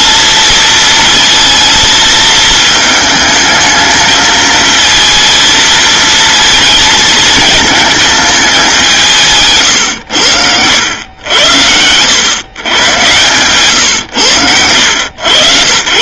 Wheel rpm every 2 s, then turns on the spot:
220, 220, 220, 220, 190, 90, 120, 90.
none